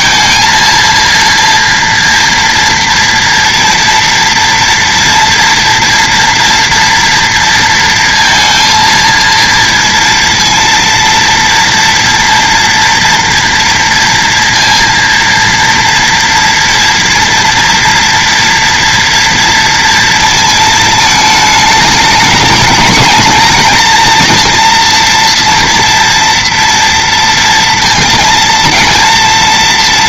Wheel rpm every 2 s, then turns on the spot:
230, 230, 230, 240, 230, 230, 230, 230, 230, 230, 220, 220, 230, 230, 230.
none